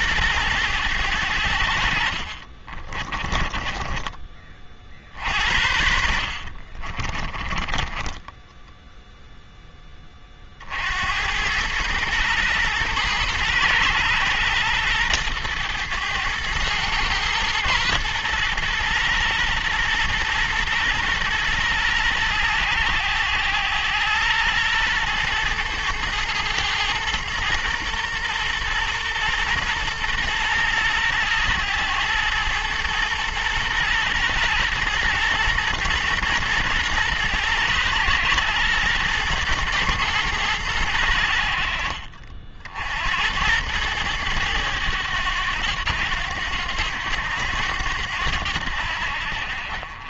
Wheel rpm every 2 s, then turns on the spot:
110, 30, 50, 40, 0, 80, 120, 110, 110, 120, 110, 110, 110, 110, 120, 110, 120, 120, 110, 110, 80, 80, 100, 90, 70.
2-4 6-8